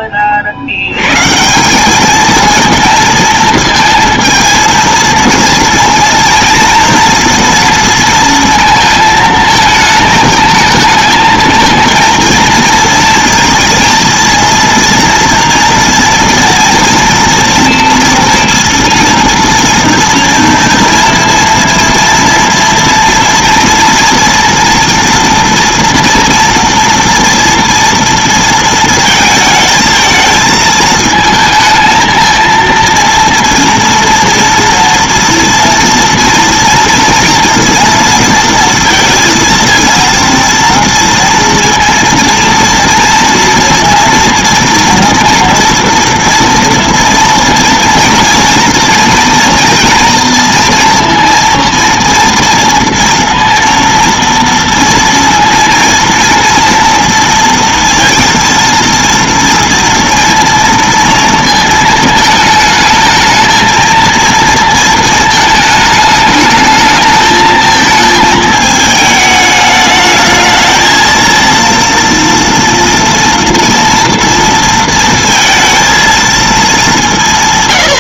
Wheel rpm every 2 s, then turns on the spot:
80, 230, 230, 240, 230, 220, 230, 230, 230, 230, 240, 230, 230, 230, 220, 220, 230, 230, 230, 230, 230, 230, 230, 230, 230, 230, 230, 230, 230, 230, 230, 220, 230, 220, 220, 220, 230, 230, 220.
none